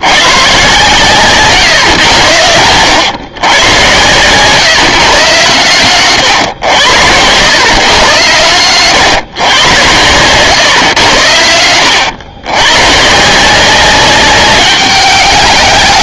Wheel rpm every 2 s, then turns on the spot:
130, 100, 130, 90, 110, 110, 120, 200.
none